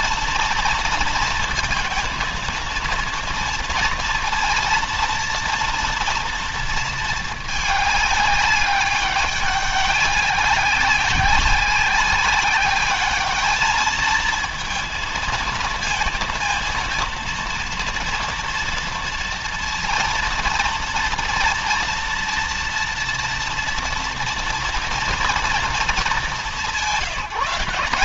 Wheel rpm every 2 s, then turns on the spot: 230, 230, 230, 220, 200, 190, 200, 230, 230, 230, 230, 230, 230, 180.
none